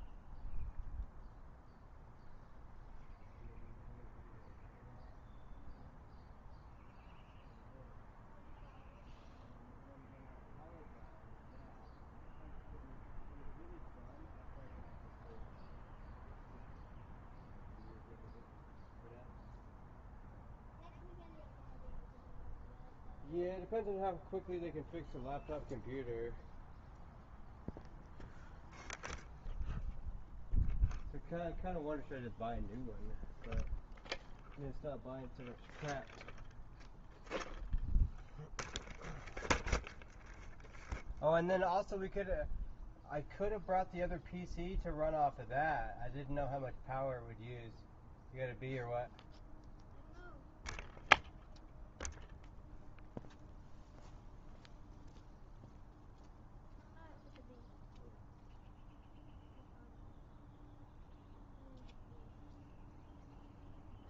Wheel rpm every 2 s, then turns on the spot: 0, 0, 0, 0, 0, 0, 0, 0, 0, 0, 0, 0, 0, 0, 0, 0, 0, 0, 0, 0, 0, 0, 0, 0, 0, 0, 0, 0, 0, 0, 0, 0.
none